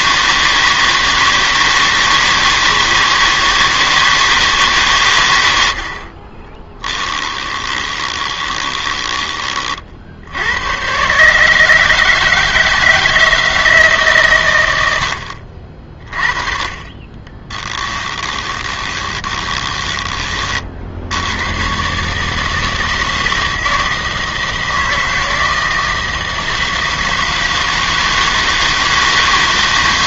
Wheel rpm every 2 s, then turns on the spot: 160, 160, 150, 10, 20, 90, 160, 110, 30, 20, 50, 160, 160, 160, 160.
6-10 18-20